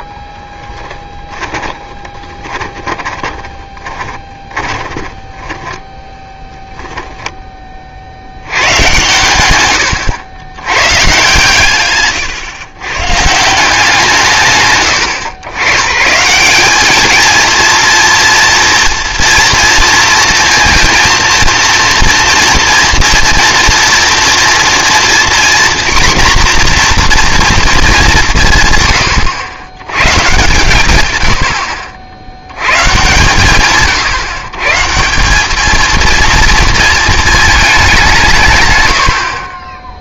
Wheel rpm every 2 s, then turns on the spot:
10, 20, 10, 10, 100, 110, 120, 120, 170, 230, 230, 230, 230, 240, 130, 120, 100, 140, 230, 120.
2-6